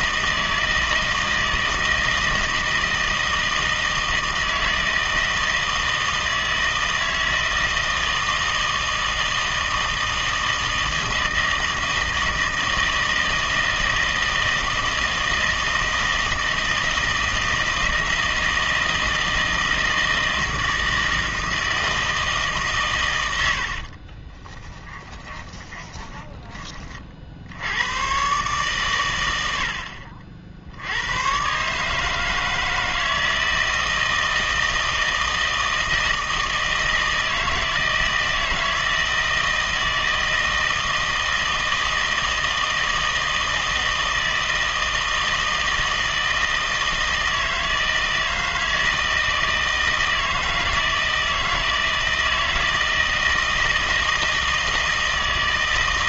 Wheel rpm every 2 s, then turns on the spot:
160, 160, 160, 160, 160, 160, 160, 160, 160, 160, 160, 130, 20, 40, 140, 70, 160, 160, 160, 160, 160, 160, 160, 160, 160, 160, 160, 160.
24-28